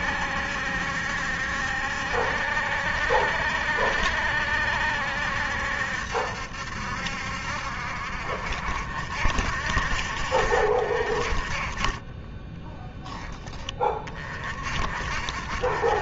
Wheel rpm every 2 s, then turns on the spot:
70, 70, 70, 70, 70, 60, 10, 50.
12-14